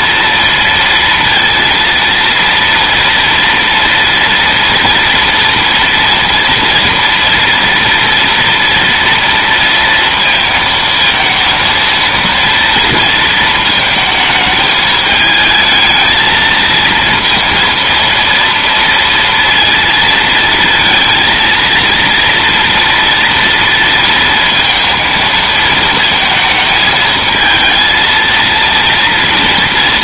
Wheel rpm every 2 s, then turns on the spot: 230, 230, 230, 230, 230, 220, 230, 220, 230, 230, 230, 230, 230, 220, 230.
none